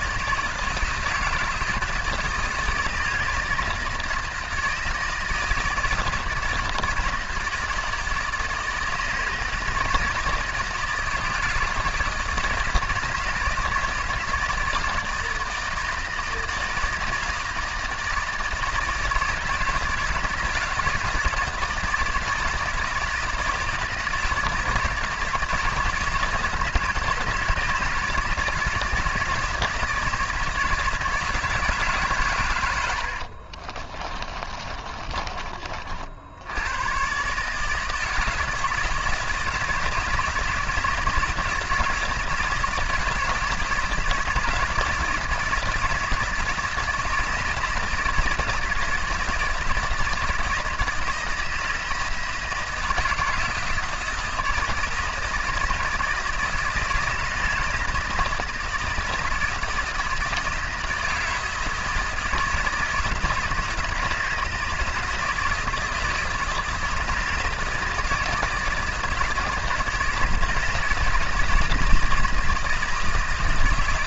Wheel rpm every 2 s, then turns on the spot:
160, 160, 160, 160, 160, 160, 160, 160, 160, 160, 160, 160, 160, 160, 160, 160, 90, 30, 100, 160, 160, 160, 170, 170, 160, 160, 160, 170, 170, 170, 160, 160, 160, 160, 170, 160, 170.
32-36